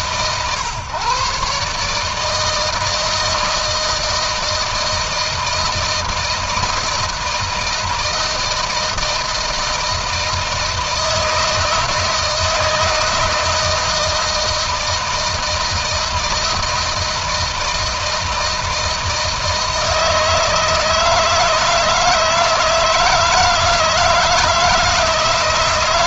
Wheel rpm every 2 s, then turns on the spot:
130, 160, 160, 160, 160, 160, 160, 160, 160, 160, 160, 160, 160.
none